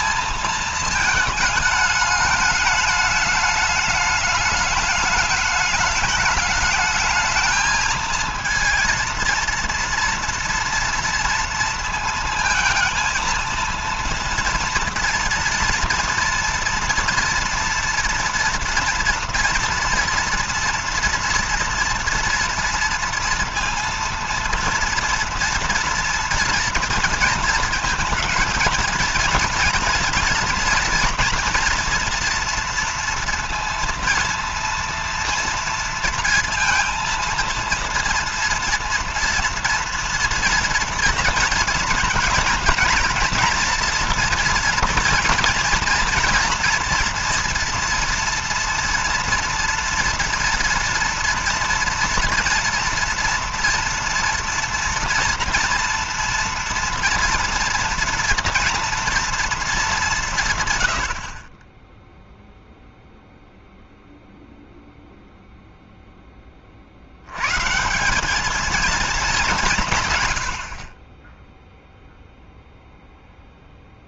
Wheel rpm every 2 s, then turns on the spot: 220, 210, 210, 210, 230, 230, 230, 230, 230, 230, 240, 230, 230, 230, 230, 230, 230, 230, 230, 240, 230, 230, 230, 240, 230, 240, 230, 230, 230, 240, 140, 0, 0, 20, 200, 70, 0.
none